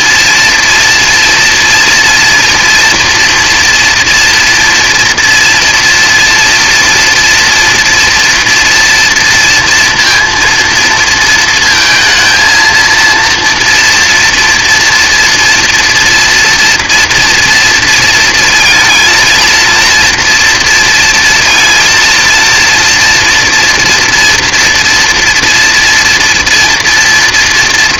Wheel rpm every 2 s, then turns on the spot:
230, 230, 230, 230, 230, 230, 230, 230, 230, 230, 230, 230, 230, 230.
none